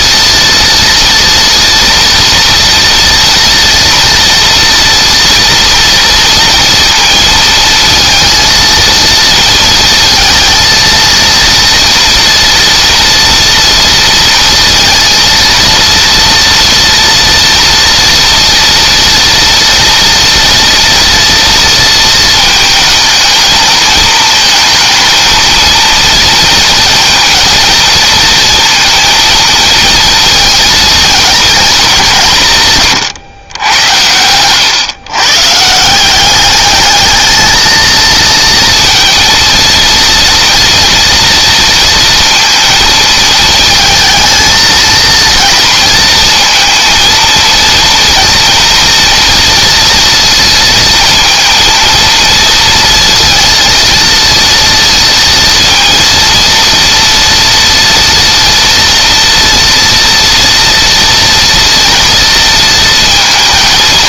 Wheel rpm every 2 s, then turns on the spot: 230, 230, 230, 230, 230, 230, 230, 230, 230, 230, 230, 220, 220, 230, 230, 220, 130, 130, 220, 230, 230, 220, 230, 220, 230, 230, 230, 230, 230, 230, 230, 230.
none